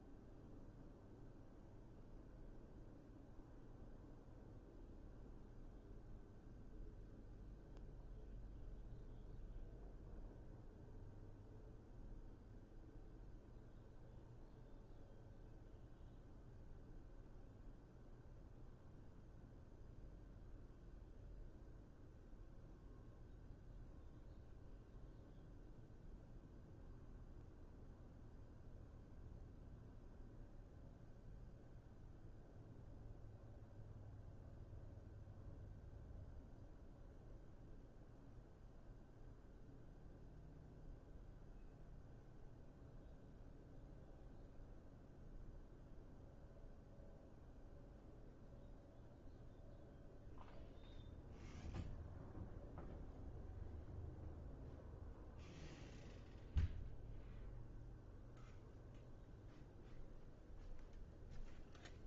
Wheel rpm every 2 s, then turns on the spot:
0, 0, 0, 0, 0, 0, 0, 0, 0, 0, 0, 0, 0, 0, 0, 0, 0, 0, 0, 0, 0, 0, 0, 0, 0, 0, 0, 0, 0, 0, 0.
none